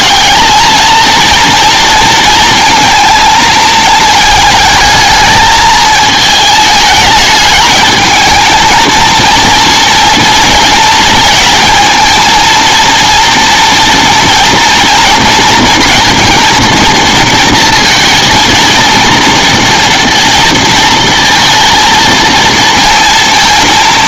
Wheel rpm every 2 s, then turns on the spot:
220, 230, 220, 220, 220, 230, 230, 230, 230, 230, 230, 230.
none